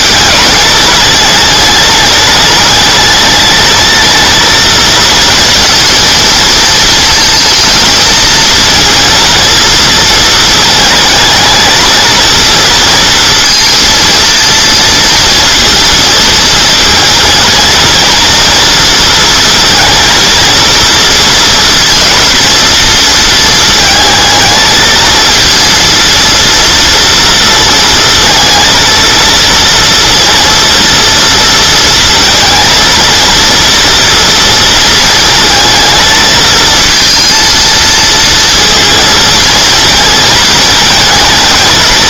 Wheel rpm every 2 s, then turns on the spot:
210, 210, 230, 230, 230, 220, 230, 230, 230, 230, 230, 230, 220, 230, 230, 230, 230, 230, 220, 230, 220.
none